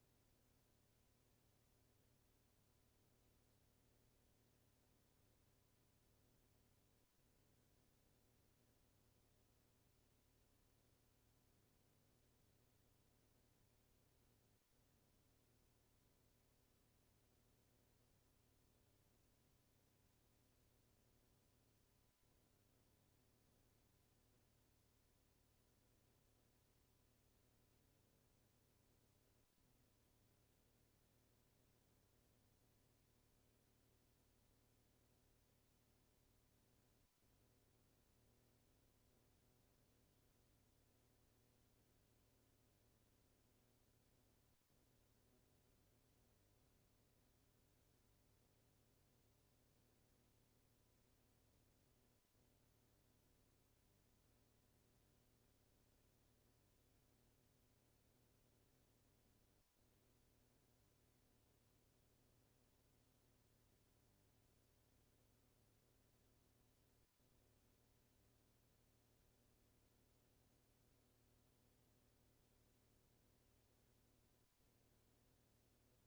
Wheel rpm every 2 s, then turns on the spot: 0, 0, 0, 0, 0, 0, 0, 0, 0, 0, 0, 0, 0, 0, 0, 0, 0, 0, 0, 0, 0, 0, 0, 0, 0, 0, 0, 0, 0, 0, 0, 0, 0, 0, 0, 0, 0, 0.
none